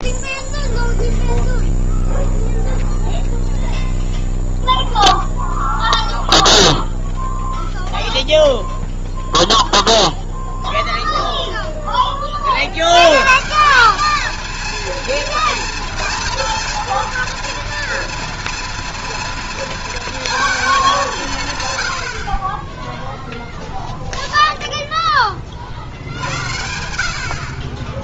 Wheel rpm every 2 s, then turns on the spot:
0, 0, 0, 0, 0, 0, 110, 230, 240, 230, 190, 0, 10, 70.
none